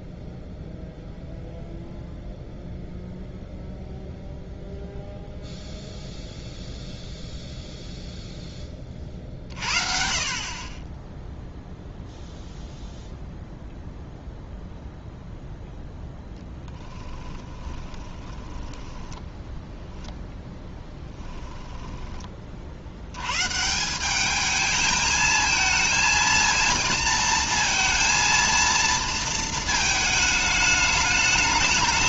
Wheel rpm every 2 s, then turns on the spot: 0, 0, 0, 0, 20, 40, 0, 0, 10, 20, 0, 40, 210, 230, 230, 210.
16-20